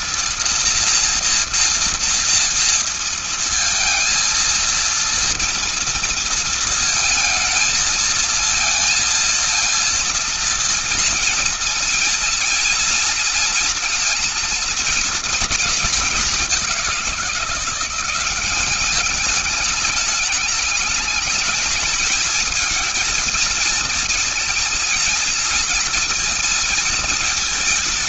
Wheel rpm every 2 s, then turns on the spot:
240, 230, 230, 230, 230, 230, 240, 230, 200, 190, 210, 220, 230, 230.
none